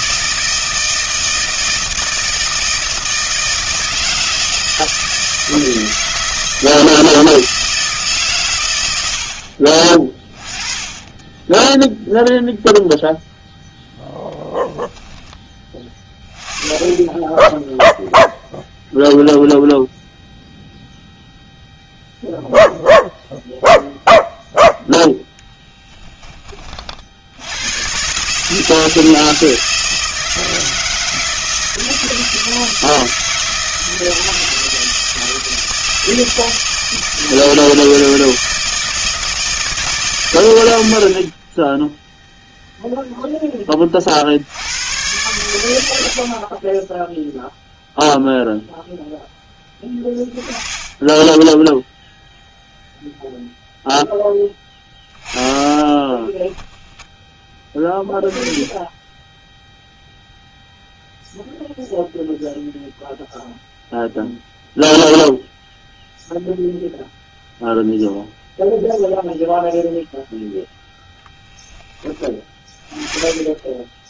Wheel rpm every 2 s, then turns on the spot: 160, 160, 160, 160, 130, 20, 0, 10, 10, 0, 0, 0, 0, 20, 150, 160, 160, 160, 160, 160, 110, 0, 70, 40, 0, 10, 0, 10, 10, 10, 0, 0, 0, 0, 0, 0, 10.
50-52 56-58